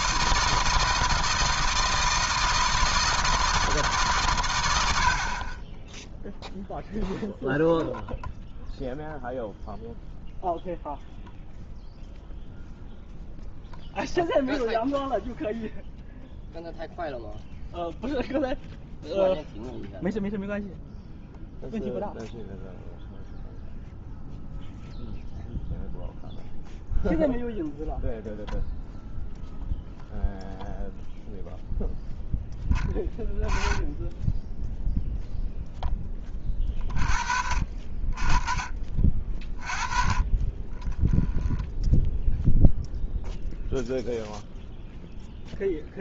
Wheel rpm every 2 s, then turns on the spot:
160, 160, 100, 0, 0, 0, 0, 0, 0, 0, 0, 0, 0, 0, 0, 0, 10, 0, 30, 30, 30, 0, 0.
none